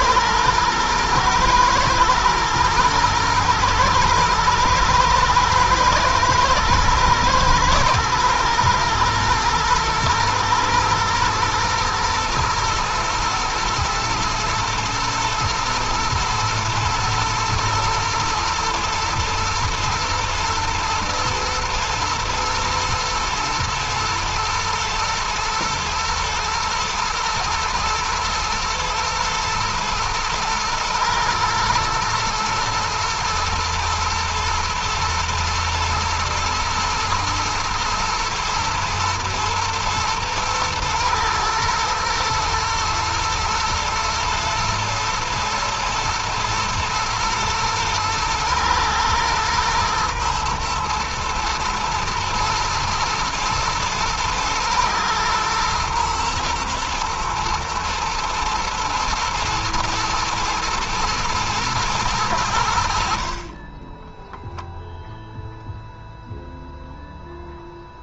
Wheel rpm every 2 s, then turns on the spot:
110, 110, 110, 120, 120, 120, 110, 110, 110, 110, 120, 110, 110, 120, 110, 120, 120, 110, 110, 110, 110, 110, 110, 110, 120, 120, 110, 120, 120, 120, 120, 70, 0, 0.
none